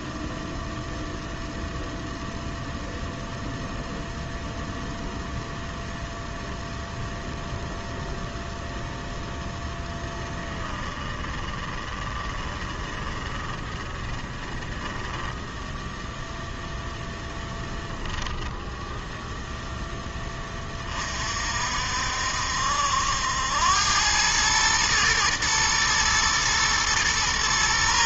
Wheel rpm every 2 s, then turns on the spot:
0, 0, 0, 0, 0, 10, 10, 10, 0, 10, 20, 70, 110, 110.
10-16